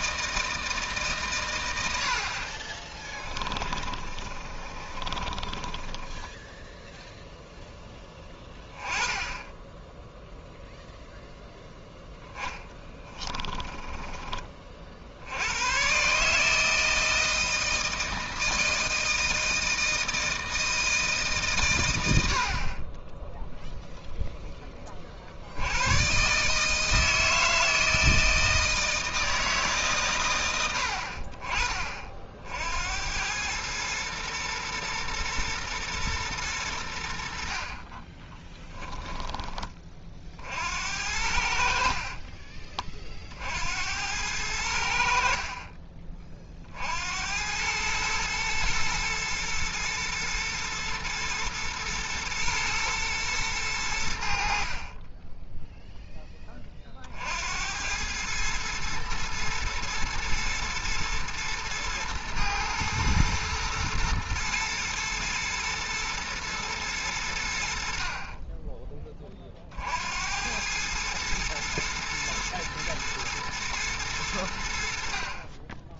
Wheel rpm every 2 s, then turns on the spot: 160, 40, 30, 0, 10, 0, 20, 40, 160, 160, 160, 40, 20, 160, 160, 80, 70, 120, 100, 10, 60, 30, 80, 50, 110, 110, 110, 40, 30, 110, 110, 120, 110, 110, 20, 100, 110, 70.
2-6 12-14 38-40